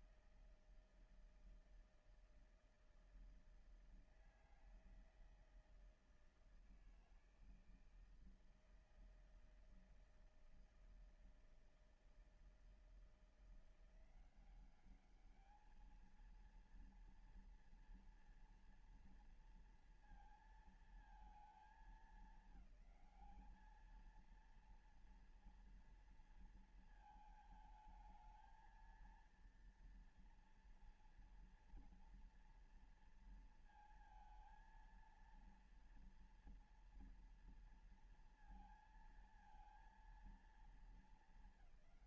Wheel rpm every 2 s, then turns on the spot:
160, 160, 160, 160, 160, 160, 160, 190, 230, 230, 230, 200, 230, 230, 220, 230, 230, 230, 230, 230, 220.
none